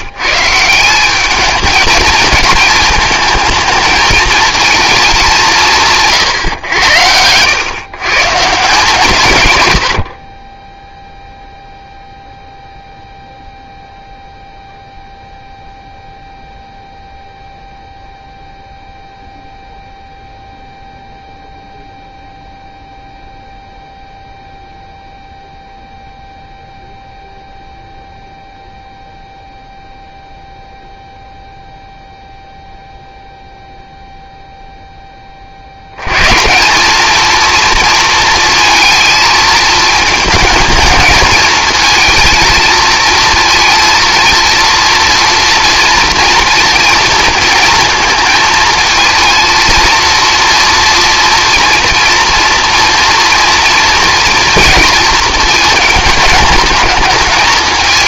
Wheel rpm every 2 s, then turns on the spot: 160, 210, 220, 120, 160, 20, 0, 0, 0, 0, 0, 0, 0, 0, 0, 0, 0, 0, 170, 230, 220, 220, 230, 230, 220, 230, 230, 230, 210.
none